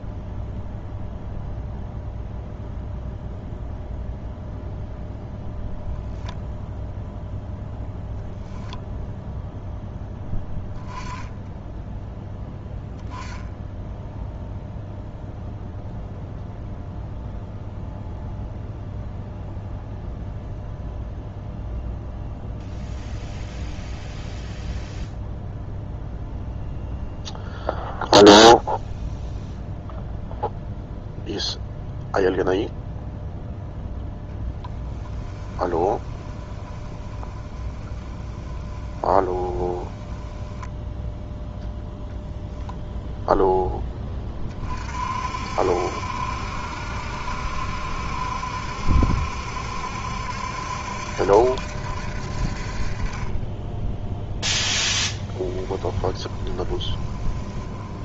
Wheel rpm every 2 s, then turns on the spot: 0, 0, 0, 0, 0, 10, 0, 0, 0, 0, 0, 0, 0, 0, 0, 0, 0, 20, 20, 20, 10, 0, 40, 70, 70, 70, 40, 0, 20.
34-42 56-58